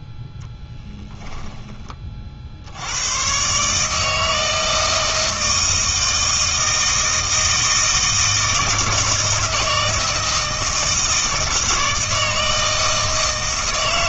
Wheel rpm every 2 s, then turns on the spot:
10, 70, 160, 160, 160, 160, 160.
none